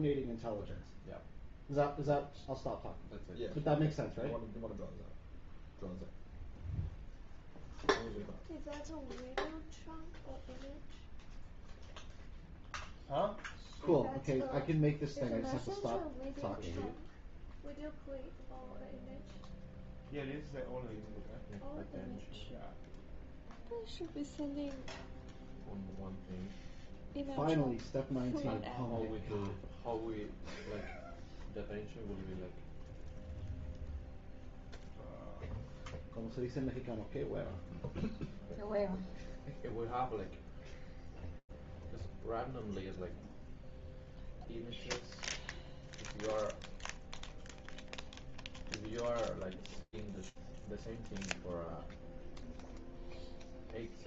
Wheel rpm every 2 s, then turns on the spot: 0, 0, 0, 0, 0, 0, 0, 0, 0, 0, 0, 0, 0, 0, 0, 0, 0, 0, 0, 0, 0, 0, 0, 0, 0, 0, 0.
none